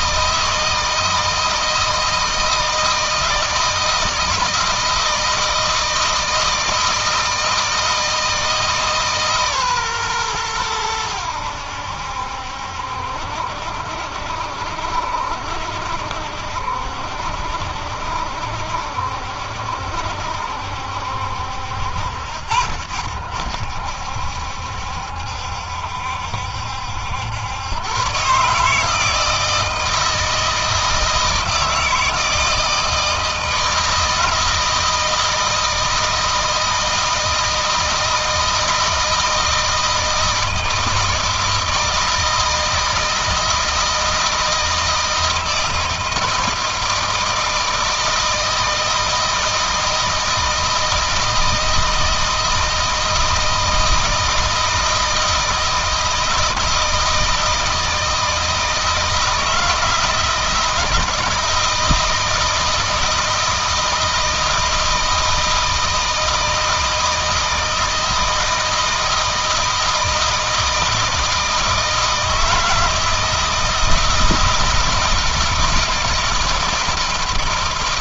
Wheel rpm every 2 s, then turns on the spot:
160, 160, 170, 160, 150, 100, 70, 70, 70, 70, 70, 70, 70, 80, 150, 160, 160, 160, 160, 160, 160, 160, 160, 160, 160, 160, 160, 160, 160, 160, 160, 160, 160, 160, 160, 160, 160, 160, 160.
none